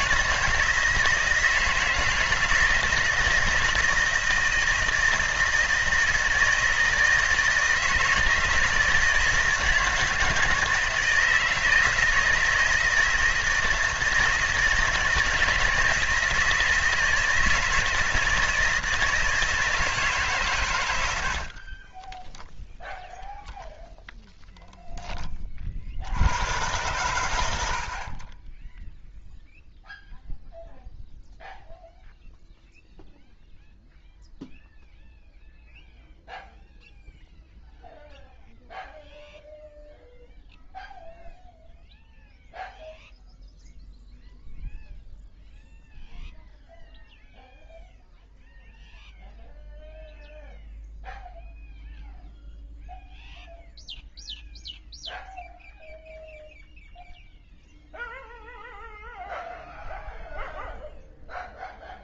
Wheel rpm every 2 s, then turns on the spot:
160, 160, 160, 160, 160, 160, 160, 170, 160, 160, 120, 0, 0, 110, 10, 0, 0, 0, 0, 0, 0, 0, 0, 0, 0, 0, 0, 0, 0, 0, 0.
none